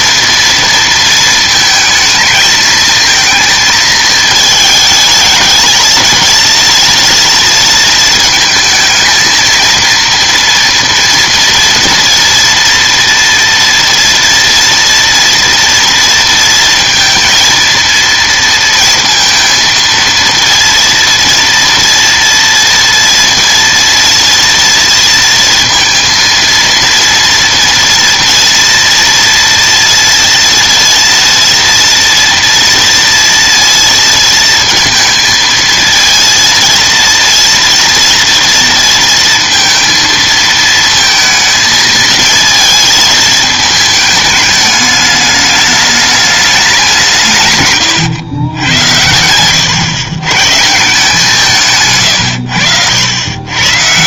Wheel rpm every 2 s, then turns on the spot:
230, 220, 220, 230, 220, 240, 230, 230, 230, 230, 230, 230, 230, 230, 230, 230, 230, 230, 230, 230, 220, 220, 210, 200, 110, 140, 90.
none